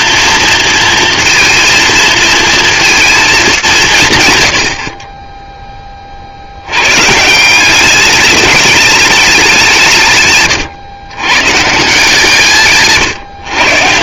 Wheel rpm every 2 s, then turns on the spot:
230, 230, 60, 110, 210, 130, 140.
none